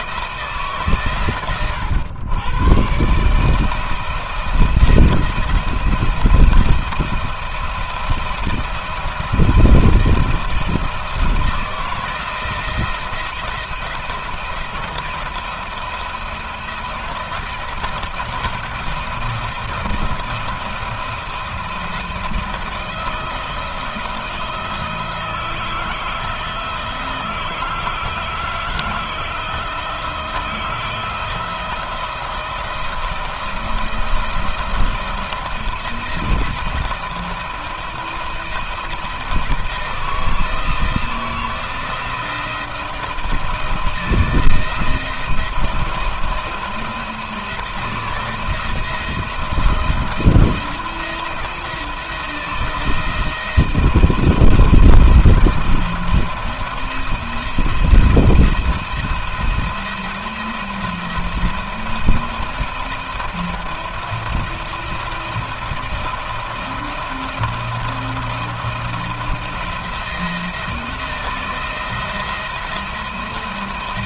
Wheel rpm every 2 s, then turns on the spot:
160, 110, 170, 170, 170, 170, 170, 170, 170, 170, 170, 170, 170, 160, 160, 170, 170, 170, 170, 160, 160, 170, 170, 170, 170, 170, 160, 160, 170, 170, 170, 170, 170, 170, 170, 170, 170.
none